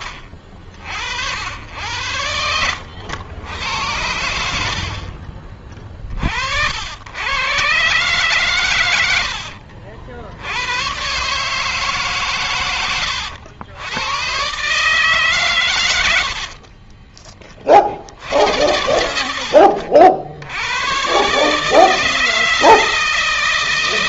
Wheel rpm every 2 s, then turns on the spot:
40, 90, 60, 90, 90, 120, 110, 140, 30, 70, 120, 160.
16-18